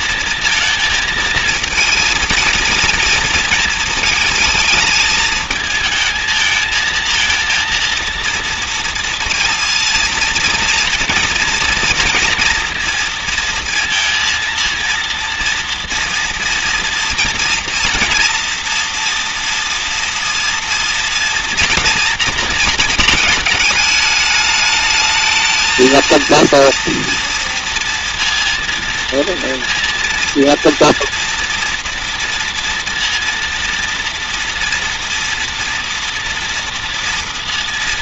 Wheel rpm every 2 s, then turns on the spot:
230, 230, 220, 220, 230, 230, 230, 230, 230, 240, 230, 230, 220, 230, 230, 230, 230, 230, 230.
none